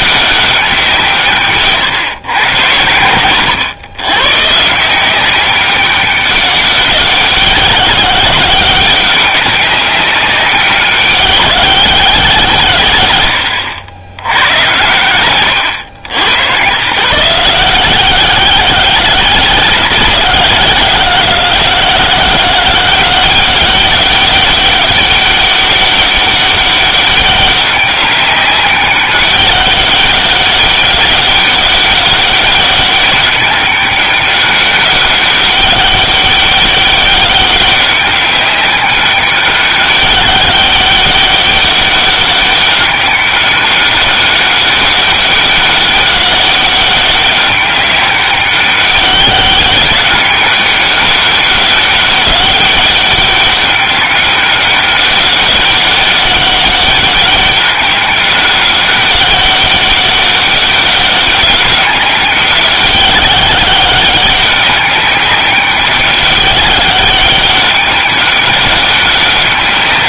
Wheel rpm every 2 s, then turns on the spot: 190, 100, 150, 200, 190, 190, 130, 90, 110, 180, 180, 190, 200, 200, 200, 200, 200, 200, 190, 200, 200, 200, 200, 190, 190, 200, 200, 200, 200, 200, 200, 190, 200, 200, 200.
none